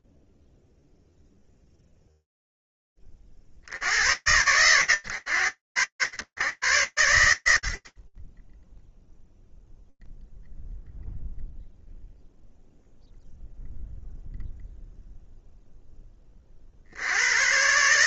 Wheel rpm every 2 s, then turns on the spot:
0, 20, 120, 110, 10, 0, 0, 0, 80.
none